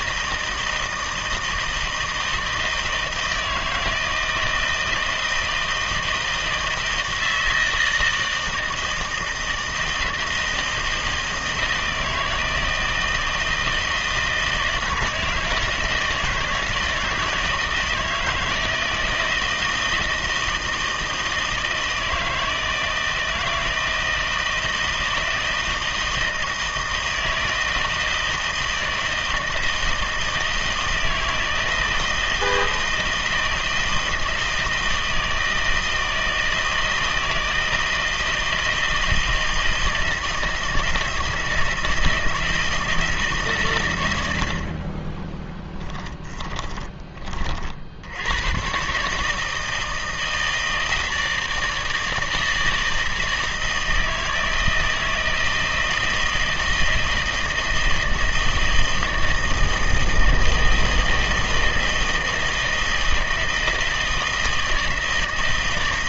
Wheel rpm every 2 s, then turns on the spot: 160, 160, 160, 160, 160, 160, 160, 160, 160, 160, 160, 160, 160, 160, 160, 160, 160, 160, 160, 160, 160, 160, 60, 20, 120, 160, 160, 160, 160, 160, 160, 160, 160.
46-48